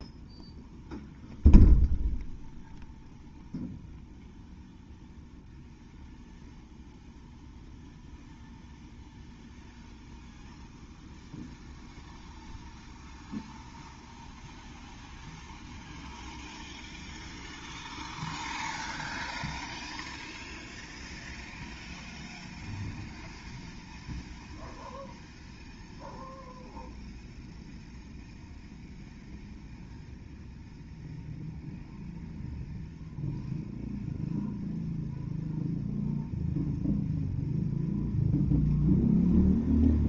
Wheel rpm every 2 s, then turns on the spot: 0, 0, 0, 0, 0, 0, 0, 0, 0, 0, 0, 0, 0, 0, 0, 0, 0, 0, 0, 0.
none